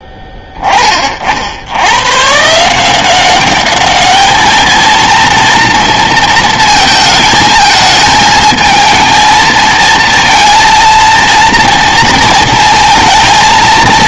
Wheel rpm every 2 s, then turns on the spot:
20, 150, 220, 220, 220, 230, 230.
none